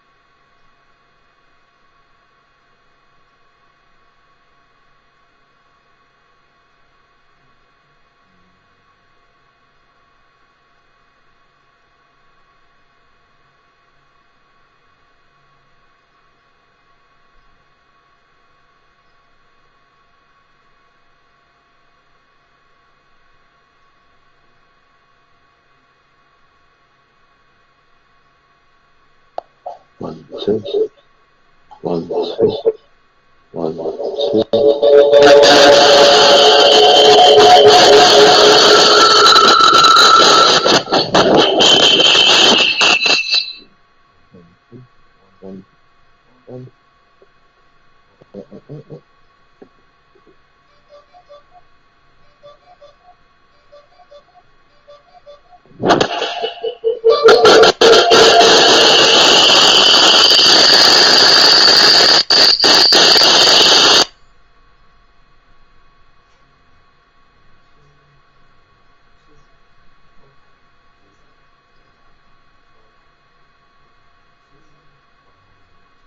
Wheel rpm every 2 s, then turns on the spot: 0, 0, 0, 0, 0, 0, 0, 0, 0, 0, 0, 0, 0, 0, 0, 0, 0, 0, 0, 0, 0, 0, 0, 0, 0, 0, 0, 0, 0, 0, 0, 0, 0, 0, 0, 0, 0, 0.
none